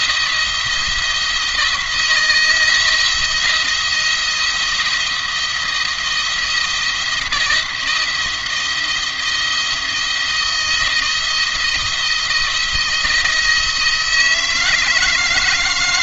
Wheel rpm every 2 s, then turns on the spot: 170, 160, 170, 170, 170, 170, 160, 160.
none